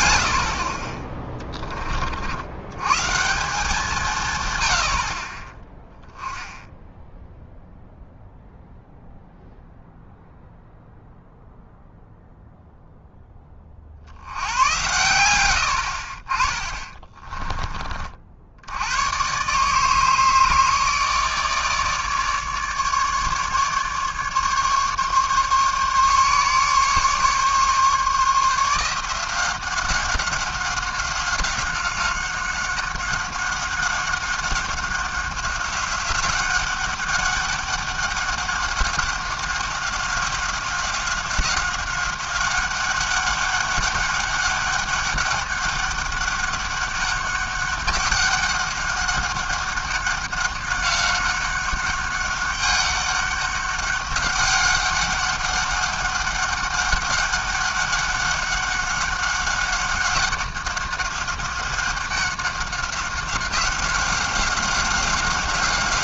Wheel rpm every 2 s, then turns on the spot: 40, 120, 80, 10, 0, 0, 0, 100, 30, 90, 150, 150, 140, 140, 170, 190, 190, 190, 190, 190, 190, 190, 200, 200, 200, 200, 200, 200, 200, 190, 190, 190, 190.
16-18